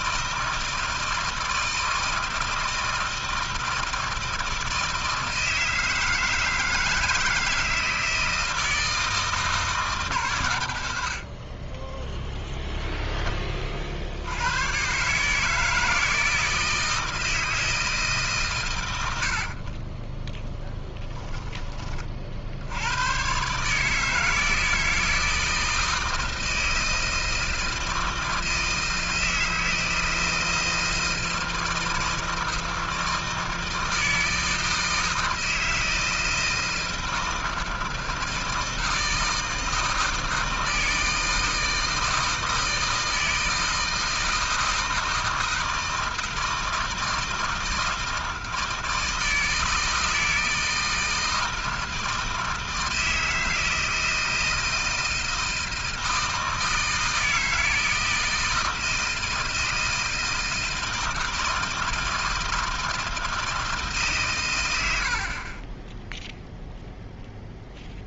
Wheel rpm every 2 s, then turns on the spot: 160, 160, 160, 160, 160, 130, 0, 90, 160, 130, 10, 70, 160, 160, 160, 160, 160, 160, 160, 160, 160, 160, 160, 160, 160, 160, 160, 160, 160, 160, 160, 160, 130, 0.
20-22